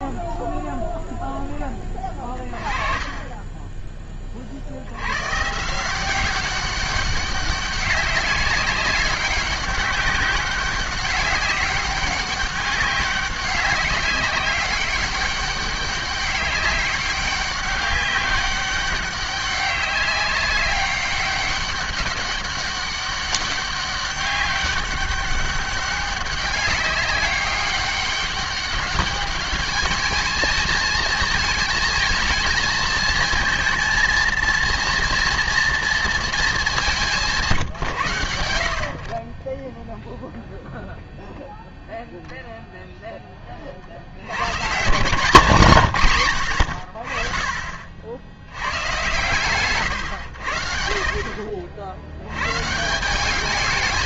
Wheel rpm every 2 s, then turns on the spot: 0, 30, 60, 190, 200, 190, 200, 190, 200, 200, 200, 200, 200, 200, 200, 220, 220, 230, 220, 80, 0, 0, 120, 90, 100, 70, 110.
none